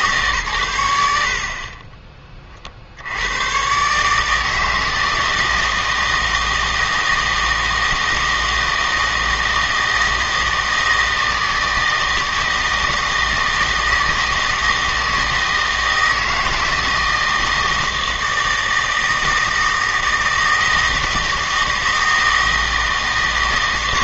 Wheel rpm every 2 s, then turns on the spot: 110, 60, 160, 160, 160, 160, 160, 160, 160, 160, 160, 160.
none